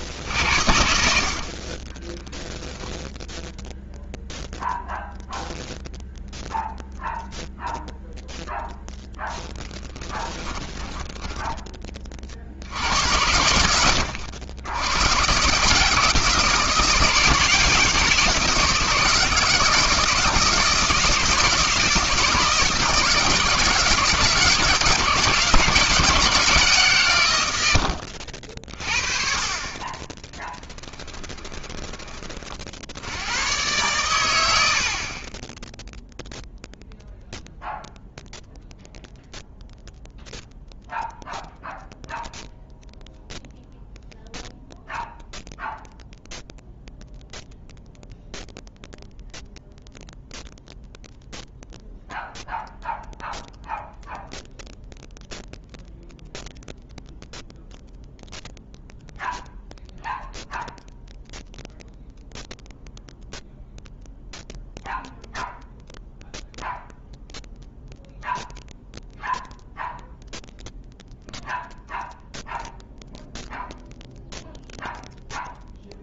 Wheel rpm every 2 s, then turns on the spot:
70, 0, 0, 0, 0, 10, 60, 90, 170, 170, 160, 160, 160, 140, 40, 10, 40, 90, 0, 0, 0, 0, 0, 0, 0, 0, 0, 0, 0, 0, 0, 0, 0, 0, 0, 0, 0, 0.
10-12 30-32